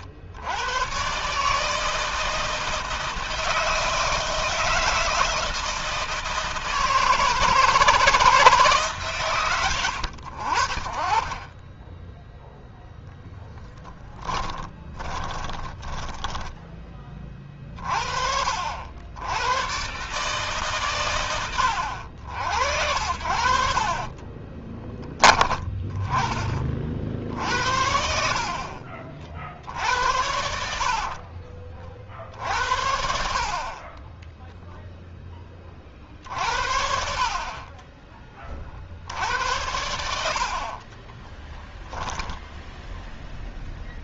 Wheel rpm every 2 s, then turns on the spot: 110, 160, 160, 160, 160, 60, 0, 10, 10, 60, 140, 80, 20, 30, 60, 70, 70, 10, 60, 20, 70, 10.
14-18 24-26 42-44